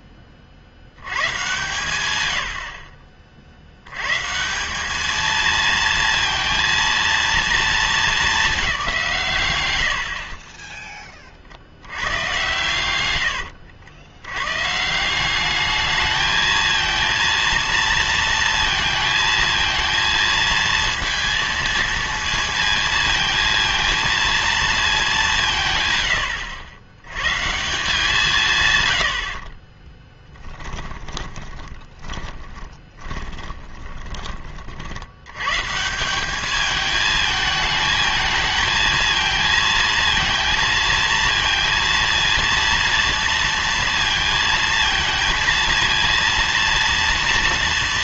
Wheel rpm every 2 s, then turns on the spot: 60, 80, 180, 230, 210, 30, 100, 120, 220, 230, 230, 230, 220, 80, 140, 10, 30, 50, 210, 220, 230, 230, 230, 230.
10-12 30-34